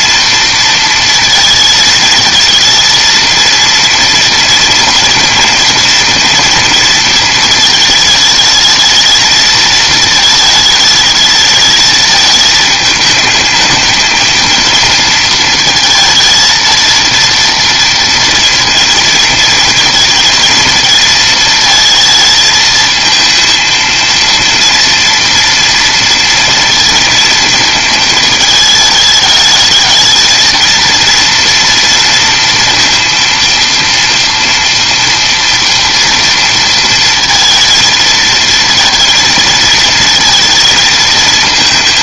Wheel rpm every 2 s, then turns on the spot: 230, 220, 240, 230, 220, 220, 220, 230, 230, 230, 230, 220, 230, 230, 220, 230, 230, 230, 230, 230, 230.
none